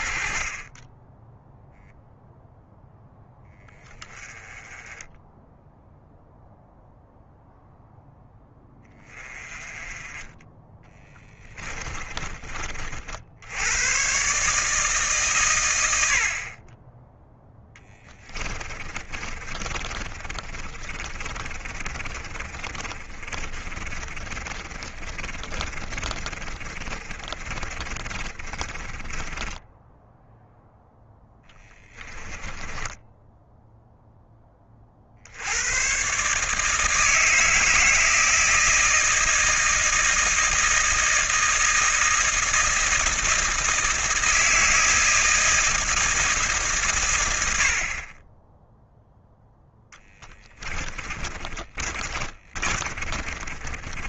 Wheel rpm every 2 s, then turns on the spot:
20, 0, 10, 0, 10, 20, 40, 150, 20, 30, 30, 30, 30, 40, 20, 0, 10, 30, 160, 160, 160, 160, 160, 130, 0, 20, 30.
10-12 18-30 32-34 50-54